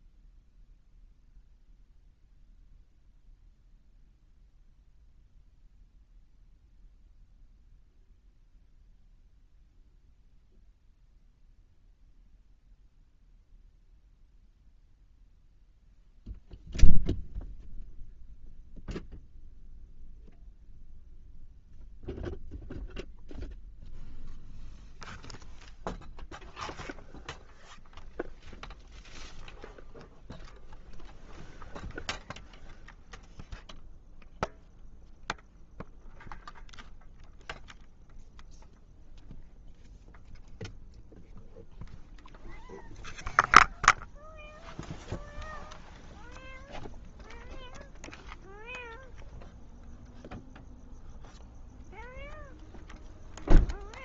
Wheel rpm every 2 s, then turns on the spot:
0, 0, 0, 0, 0, 0, 0, 0, 0, 0, 0, 0, 0, 0, 0, 0, 0, 0, 0, 0, 0, 0, 0, 0, 0, 0, 0.
none